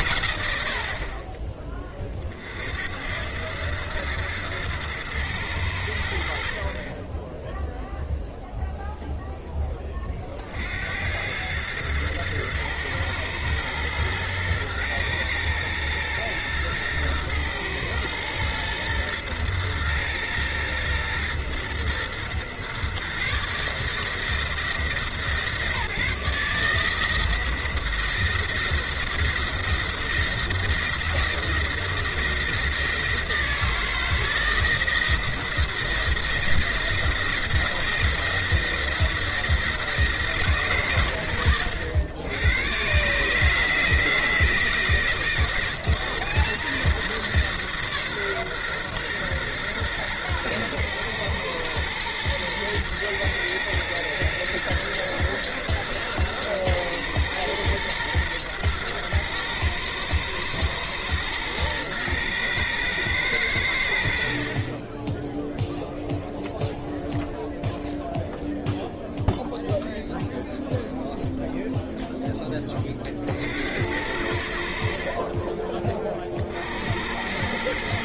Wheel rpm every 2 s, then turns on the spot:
90, 60, 110, 70, 0, 60, 110, 110, 120, 120, 120, 130, 160, 160, 170, 170, 160, 170, 170, 170, 120, 100, 160, 160, 130, 120, 120, 110, 120, 120, 110, 120, 40, 0, 0, 0, 10, 70, 60.
none